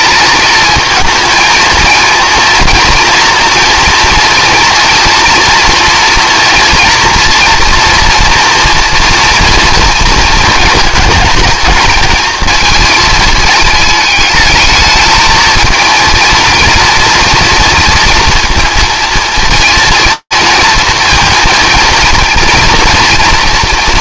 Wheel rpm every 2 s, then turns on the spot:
220, 230, 230, 230, 230, 220, 220, 210, 230, 230, 230, 230.
none